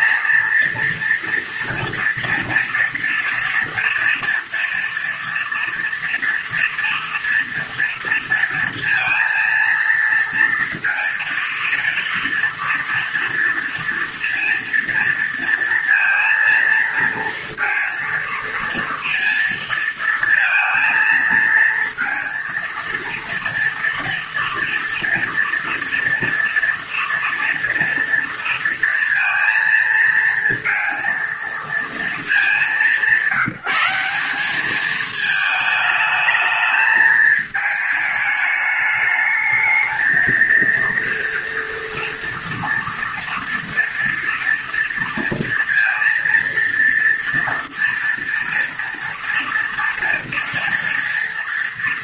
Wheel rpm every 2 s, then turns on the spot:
230, 230, 230, 240, 230, 230, 230, 230, 230, 230, 230, 230, 230, 230, 230, 230, 180, 220, 220, 210, 230, 230, 240, 230, 230, 230.
none